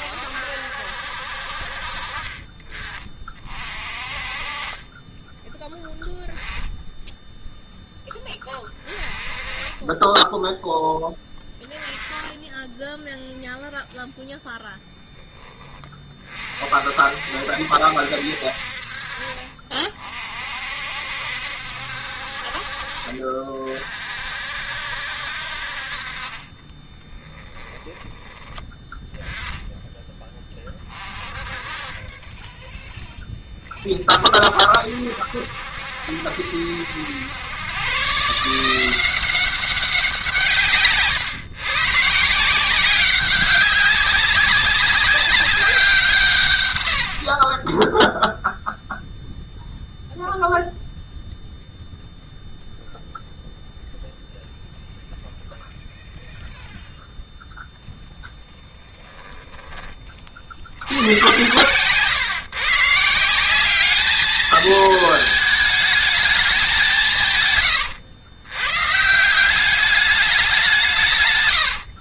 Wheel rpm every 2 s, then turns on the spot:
60, 30, 30, 10, 20, 10, 10, 0, 50, 50, 60, 40, 60, 20, 10, 20, 10, 60, 80, 160, 150, 170, 200, 100, 0, 0, 0, 0, 0, 10, 80, 140, 220, 190, 130, 180.
4-6 26-28